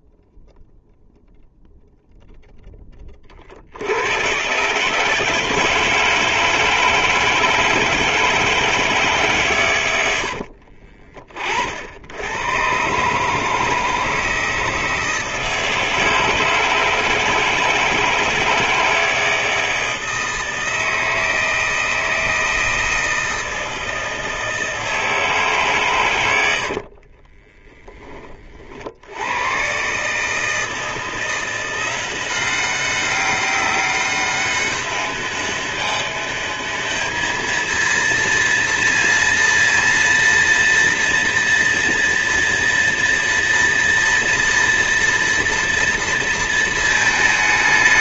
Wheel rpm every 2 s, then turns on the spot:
0, 20, 150, 160, 150, 50, 130, 160, 160, 160, 160, 160, 160, 40, 60, 170, 190, 200, 220, 230, 230, 240, 240, 220.
10-12 26-28